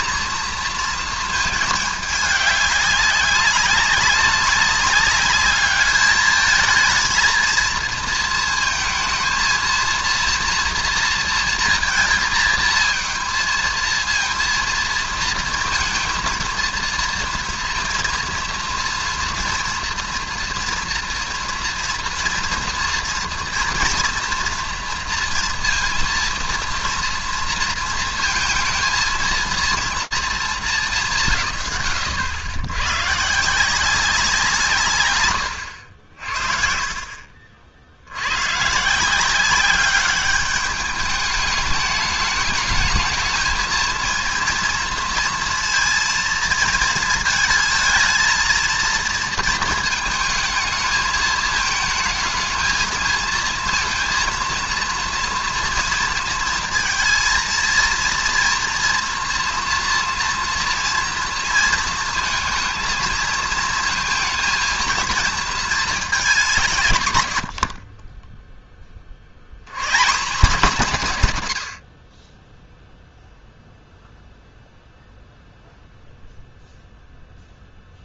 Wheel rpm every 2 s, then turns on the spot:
230, 200, 200, 220, 220, 230, 220, 230, 230, 230, 230, 230, 230, 230, 230, 220, 100, 160, 50, 140, 210, 220, 230, 230, 230, 220, 220, 230, 230, 230, 230, 230, 230, 160, 10, 200, 10, 0, 0.
none